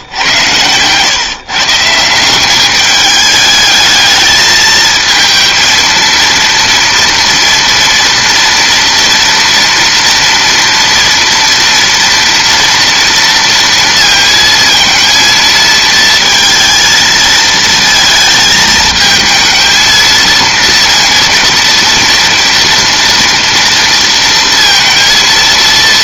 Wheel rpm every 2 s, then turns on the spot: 130, 210, 220, 230, 230, 240, 230, 230, 230, 220, 230, 240, 230.
none